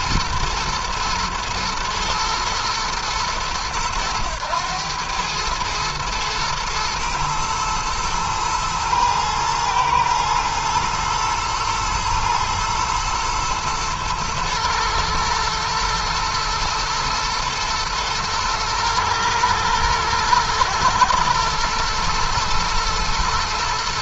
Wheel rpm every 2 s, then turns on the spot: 110, 110, 110, 110, 120, 110, 120, 110, 110, 110, 120, 110.
none